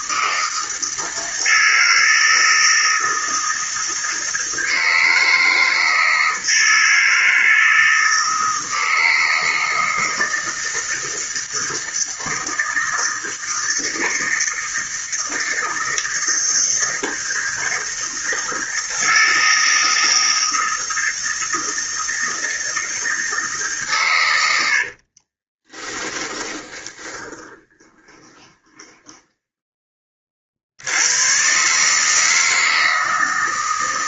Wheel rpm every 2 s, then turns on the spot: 160, 160, 160, 160, 160, 160, 160, 160, 160, 160, 160, 160, 60, 10, 10, 70, 160.
24-30